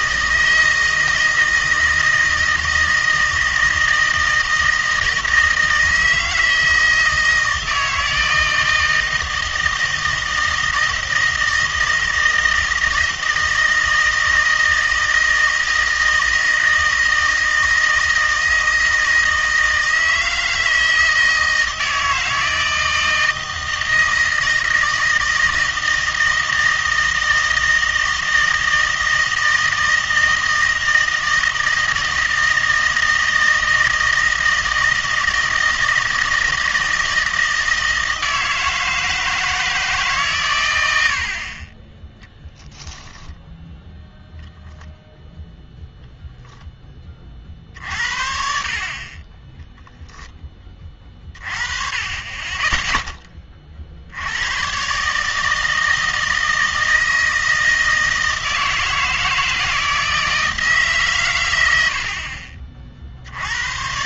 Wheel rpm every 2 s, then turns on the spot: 160, 160, 160, 160, 160, 160, 160, 160, 160, 160, 160, 160, 160, 160, 160, 160, 160, 160, 160, 160, 60, 10, 0, 40, 20, 30, 20, 150, 160, 160, 120, 60.
none